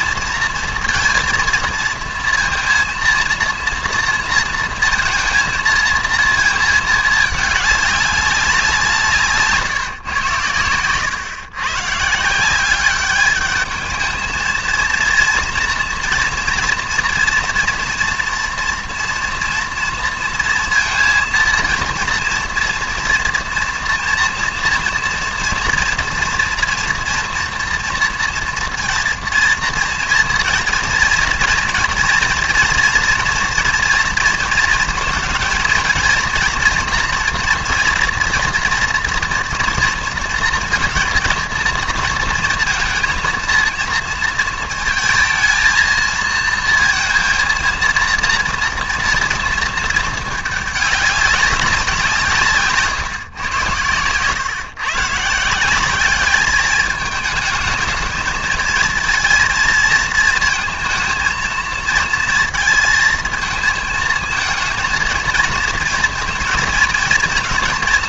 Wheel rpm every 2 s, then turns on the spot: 230, 230, 230, 220, 190, 110, 190, 230, 240, 240, 230, 240, 230, 240, 230, 230, 240, 230, 230, 230, 230, 230, 230, 230, 230, 210, 160, 130, 210, 230, 220, 230, 220, 230.
none